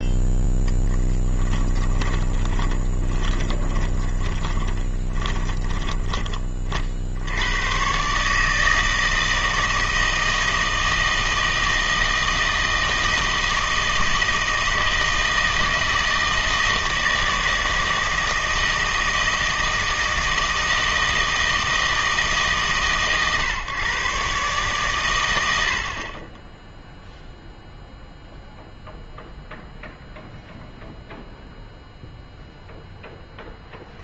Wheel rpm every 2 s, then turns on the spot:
0, 20, 30, 30, 160, 160, 160, 160, 160, 160, 160, 150, 130, 10, 0, 0, 0.
2-6